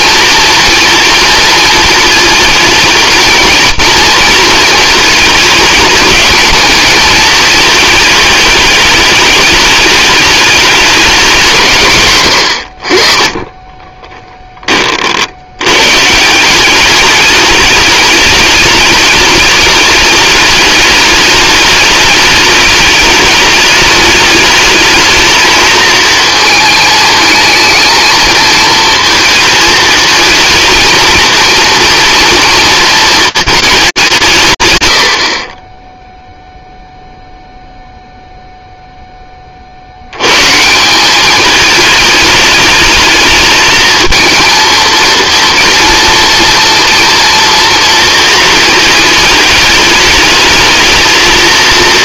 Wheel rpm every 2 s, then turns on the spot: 230, 220, 230, 220, 210, 210, 90, 20, 190, 210, 210, 210, 220, 220, 220, 230, 230, 130, 0, 0, 160, 210, 220, 230, 220, 220.
none